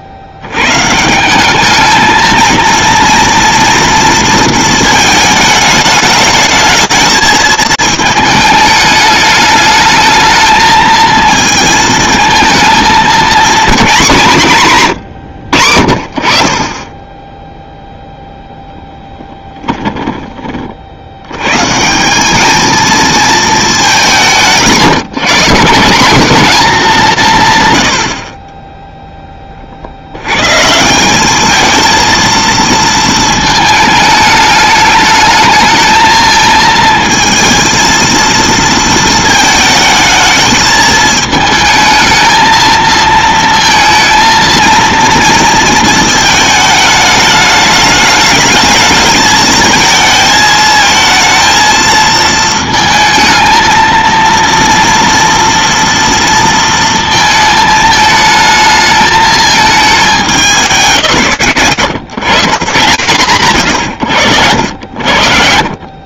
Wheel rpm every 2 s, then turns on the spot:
10, 180, 230, 220, 220, 210, 220, 220, 90, 0, 20, 150, 210, 170, 120, 40, 220, 220, 220, 230, 220, 220, 220, 220, 210, 220, 230, 230, 230, 220, 220, 160, 80.
20-22